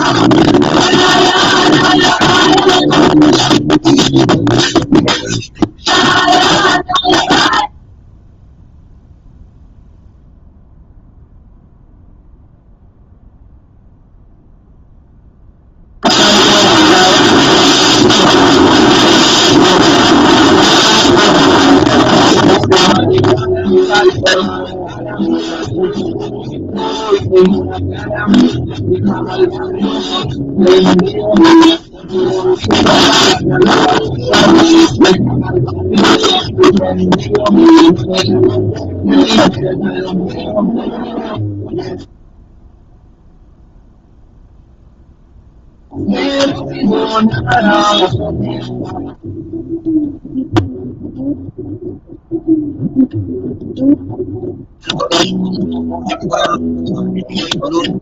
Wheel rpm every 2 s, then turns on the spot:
0, 0, 0, 0, 0, 0, 0, 0, 0, 0, 0, 0, 0, 0, 0, 0, 0, 0, 0, 0, 0, 0, 0, 0, 0, 0, 0, 0, 0.
none